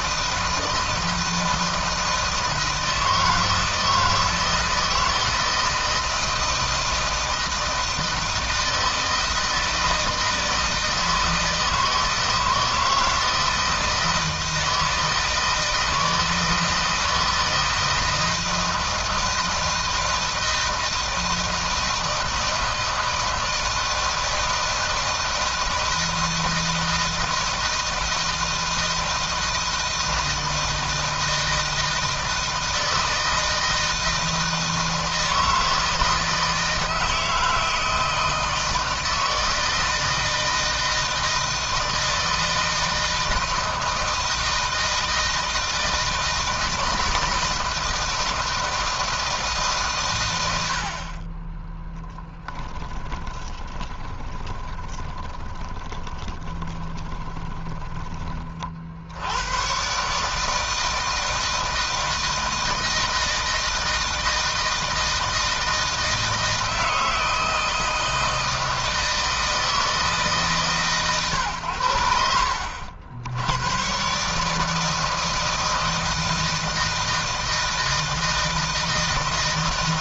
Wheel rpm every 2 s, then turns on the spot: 160, 160, 160, 160, 160, 160, 160, 160, 160, 160, 160, 160, 160, 160, 160, 160, 160, 160, 160, 160, 160, 160, 160, 160, 160, 40, 10, 20, 20, 70, 160, 160, 160, 160, 160, 130, 80, 160, 160, 160.
52-58